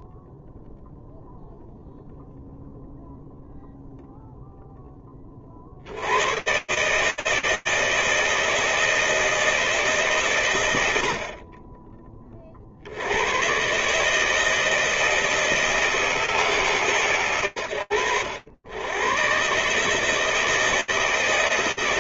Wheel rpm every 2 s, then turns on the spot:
0, 0, 10, 140, 160, 110, 60, 160, 110, 100, 160.
none